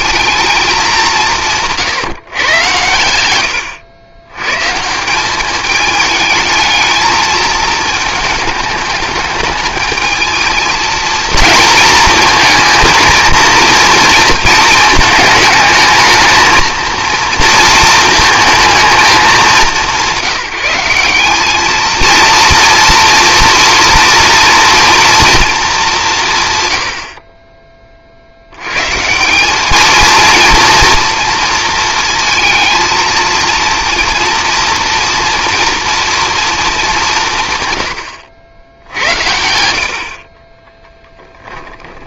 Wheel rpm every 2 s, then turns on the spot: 210, 110, 150, 220, 210, 220, 220, 220, 230, 220, 180, 230, 230, 100, 120, 230, 230, 230, 210, 80, 20.
40-42